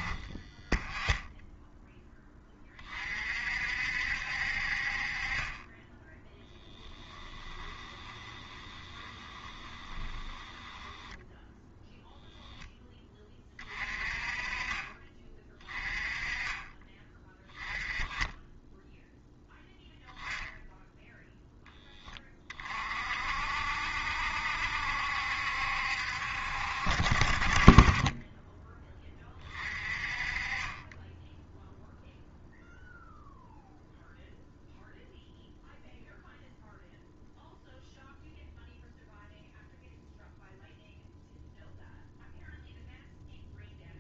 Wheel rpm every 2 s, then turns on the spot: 10, 30, 50, 10, 20, 10, 10, 30, 20, 10, 10, 30, 70, 60, 20, 20, 0, 0, 0, 0, 0, 0.
6-12